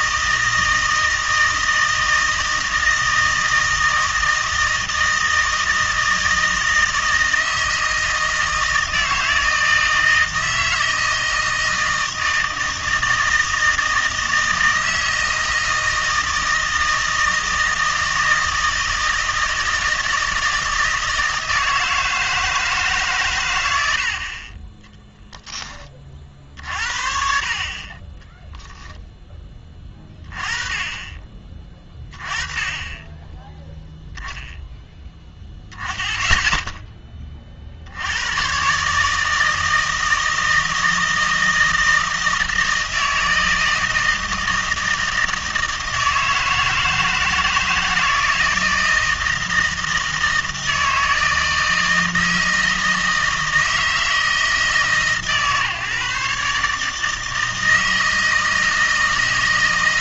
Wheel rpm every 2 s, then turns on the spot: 160, 160, 160, 160, 160, 160, 160, 160, 160, 160, 160, 150, 10, 50, 0, 20, 20, 0, 10, 130, 160, 160, 160, 160, 160, 160, 160, 150, 150, 160.
none